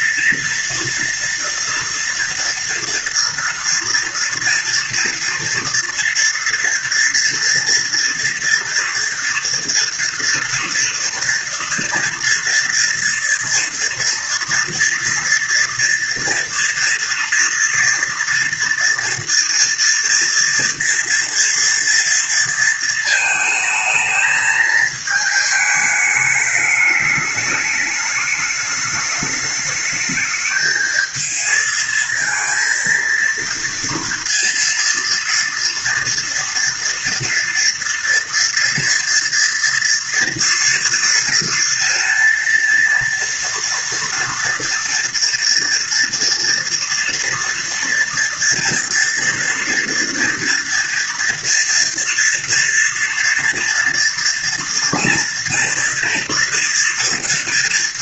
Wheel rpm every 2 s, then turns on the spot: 230, 230, 230, 230, 240, 230, 230, 230, 230, 230, 240, 230, 220, 210, 210, 220, 230, 230, 230, 230, 230, 230, 230, 230, 230, 230, 230, 230, 240.
none